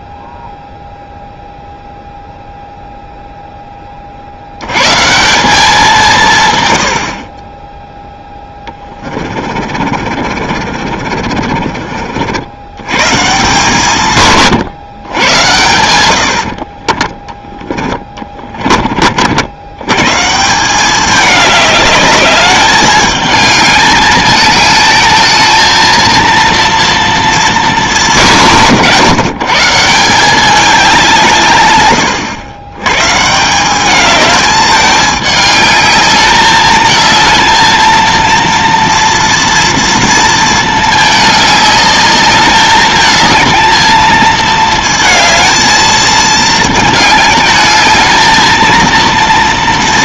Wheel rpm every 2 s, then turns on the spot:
0, 0, 90, 120, 10, 50, 90, 130, 40, 30, 180, 210, 220, 230, 150, 200, 110, 210, 210, 230, 220, 210, 220, 220, 230.
8-12 16-18